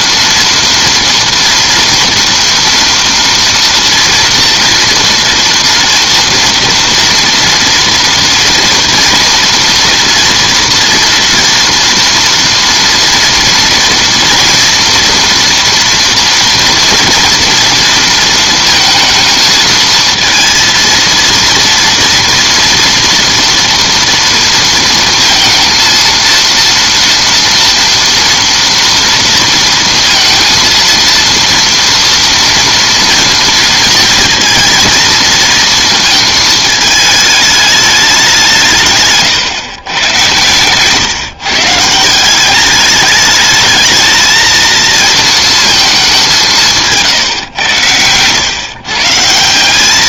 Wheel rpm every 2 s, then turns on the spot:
230, 230, 230, 230, 230, 230, 230, 230, 230, 230, 230, 230, 230, 230, 230, 230, 230, 230, 220, 150, 130, 210, 220, 150, 130.
none